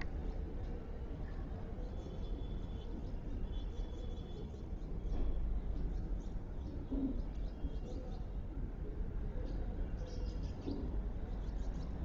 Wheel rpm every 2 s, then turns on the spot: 0, 0, 0, 0, 0, 0.
none